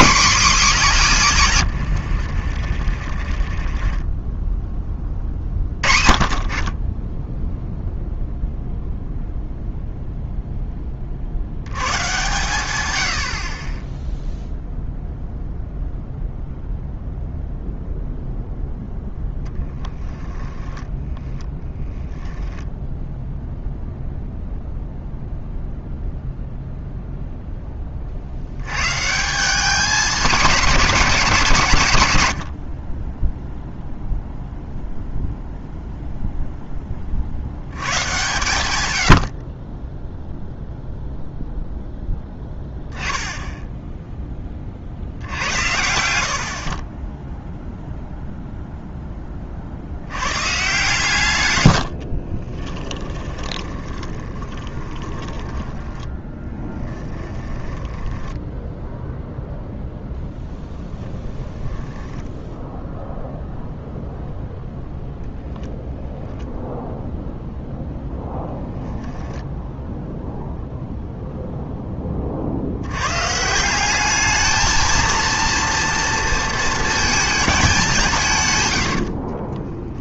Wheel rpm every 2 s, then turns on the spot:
50, 10, 50, 0, 0, 120, 20, 0, 0, 0, 0, 0, 0, 10, 190, 160, 0, 0, 70, 40, 0, 10, 70, 10, 10, 140, 20, 10, 10, 0, 0, 0, 0, 0, 0, 0, 110, 230, 220, 70.
0-4 44-48 50-58 78-80